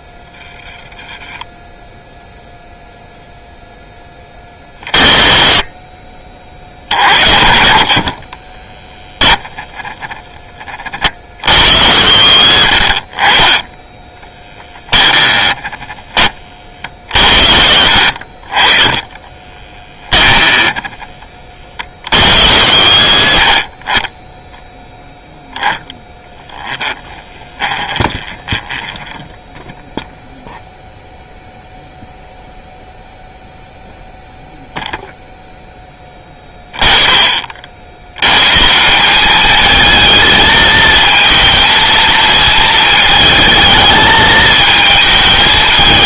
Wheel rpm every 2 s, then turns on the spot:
10, 0, 30, 60, 10, 40, 50, 10, 40, 20, 10, 70, 0, 10, 10, 0, 0, 0, 20, 170, 220, 220, 220.
8-10 12-16 26-30